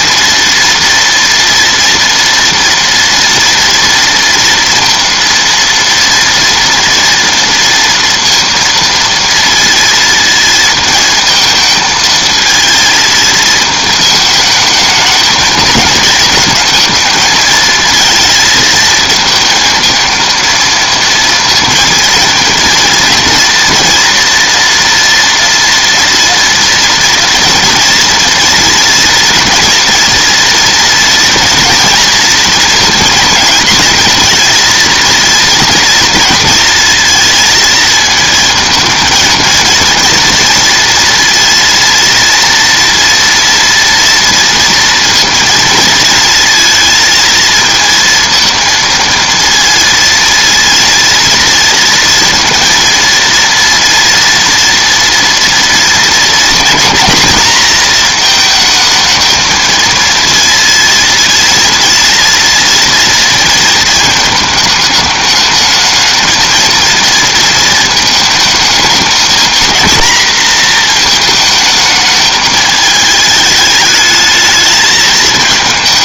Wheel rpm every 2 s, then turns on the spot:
230, 230, 230, 230, 230, 220, 230, 220, 220, 230, 230, 230, 240, 230, 230, 230, 230, 230, 230, 230, 230, 230, 230, 230, 230, 230, 230, 230, 230, 220, 230, 230, 220, 230, 220, 230, 220, 220.
none